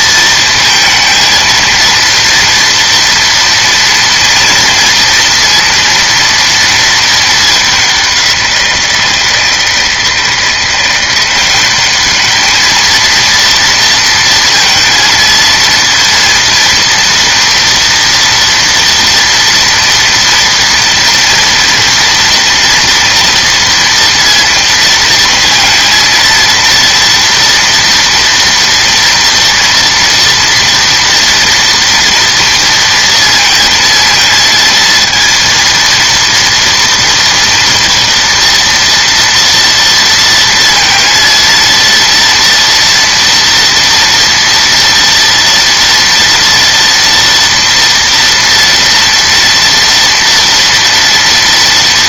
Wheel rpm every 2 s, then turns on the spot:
220, 230, 230, 230, 170, 170, 220, 230, 230, 230, 230, 230, 230, 230, 240, 230, 230, 230, 230, 230, 230, 230, 230, 230, 230, 230.
none